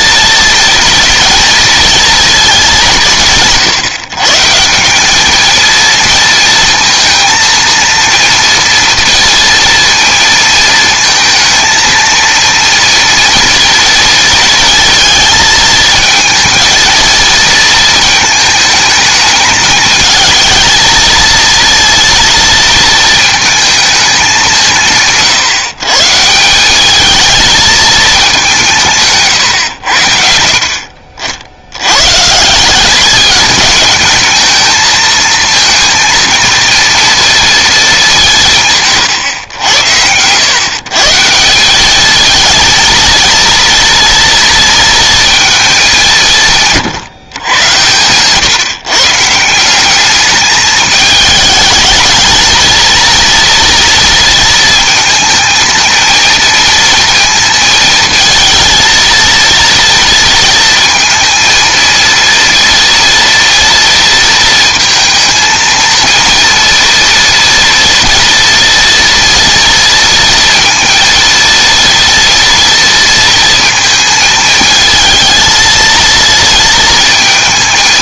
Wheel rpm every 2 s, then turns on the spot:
230, 180, 180, 230, 230, 220, 230, 230, 230, 220, 230, 230, 170, 200, 160, 60, 190, 220, 230, 130, 140, 220, 230, 150, 150, 210, 230, 230, 230, 230, 230, 230, 230, 230, 230, 230, 230, 220, 230.
none